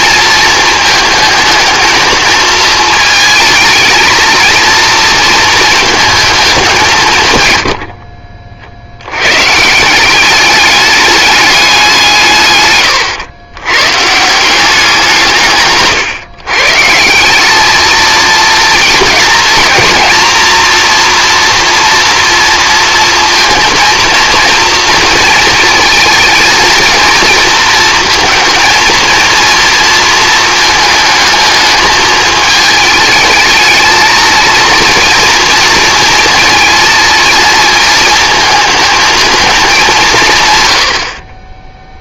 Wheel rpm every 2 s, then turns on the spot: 220, 220, 230, 180, 60, 210, 140, 180, 150, 220, 230, 230, 230, 230, 230, 220, 220, 230, 230, 220, 100.
none